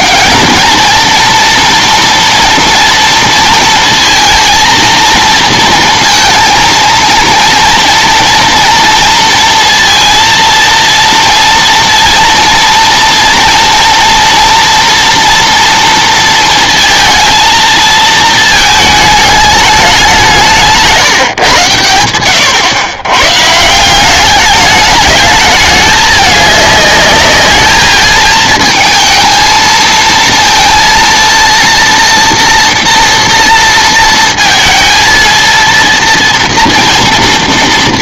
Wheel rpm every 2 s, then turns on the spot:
220, 230, 230, 230, 230, 230, 230, 240, 230, 220, 180, 110, 210, 210, 220, 230, 230, 230, 230.
none